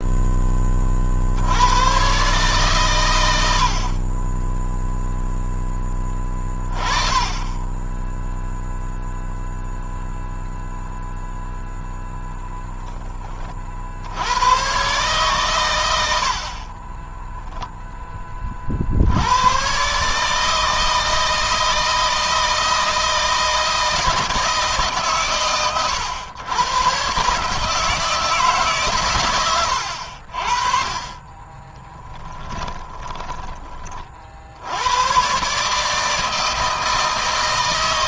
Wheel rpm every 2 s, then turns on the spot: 10, 130, 20, 20, 10, 0, 20, 110, 60, 30, 150, 160, 150, 110, 150, 60, 10, 60, 160.
32-34